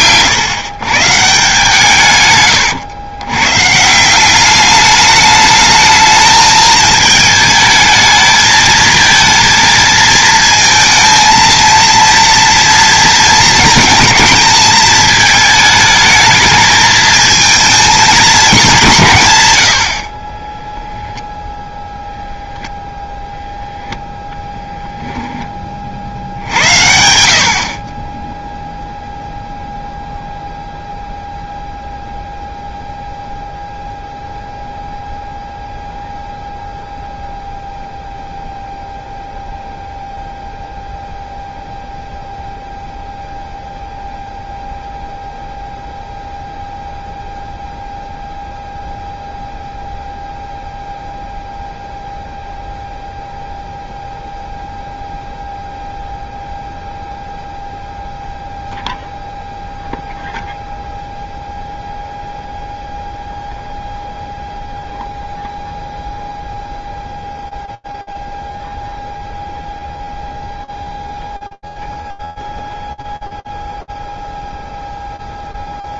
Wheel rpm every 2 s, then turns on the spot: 130, 110, 210, 220, 220, 230, 230, 220, 220, 180, 10, 0, 0, 80, 0, 0, 0, 0, 0, 0, 0, 0, 0, 0, 0, 0, 0, 0, 0, 0, 0, 0, 0, 0, 0, 0, 0, 0.
none